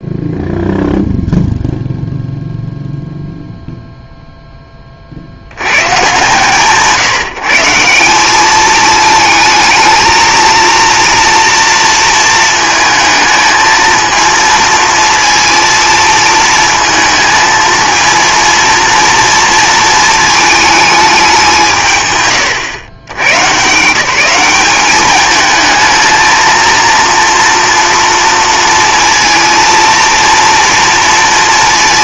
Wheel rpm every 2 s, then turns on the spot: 0, 0, 20, 140, 210, 230, 220, 230, 230, 230, 220, 110, 200, 230, 230, 230.
none